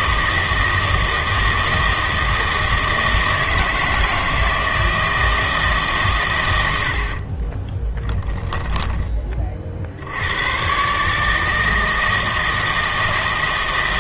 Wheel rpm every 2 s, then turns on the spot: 160, 160, 160, 90, 10, 130, 160.
8-10